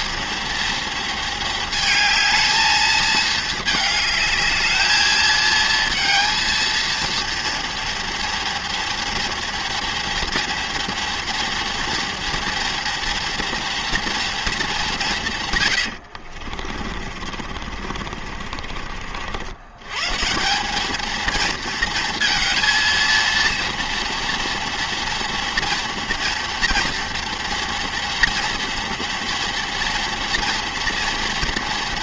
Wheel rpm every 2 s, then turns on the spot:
230, 220, 220, 230, 230, 230, 230, 170, 40, 60, 220, 230, 230, 230, 230, 230.
16-18